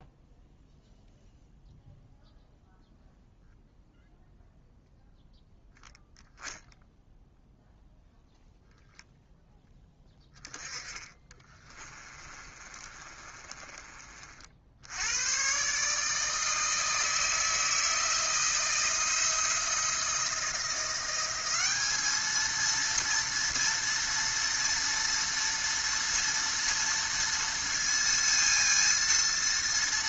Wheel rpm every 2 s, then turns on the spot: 0, 0, 0, 0, 0, 10, 30, 60, 160, 160, 170, 220, 230, 230, 230.
12-14